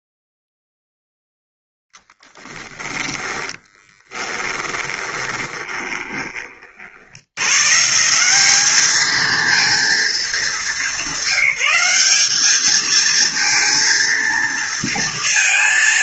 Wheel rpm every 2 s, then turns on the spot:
0, 10, 20, 60, 210, 200, 220, 230.
2-6